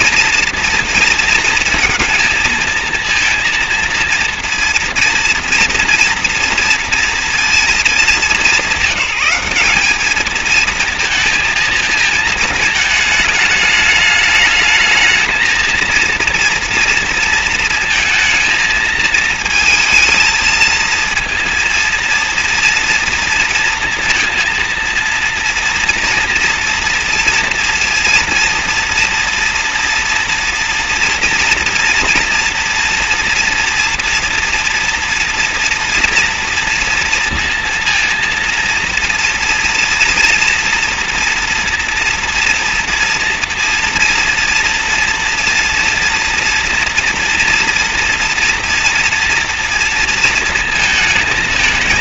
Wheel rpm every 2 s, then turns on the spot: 240, 230, 230, 230, 200, 230, 220, 220, 230, 220, 230, 240, 230, 230, 230, 240, 230, 230, 230, 240, 230, 230, 240, 230, 230, 230.
none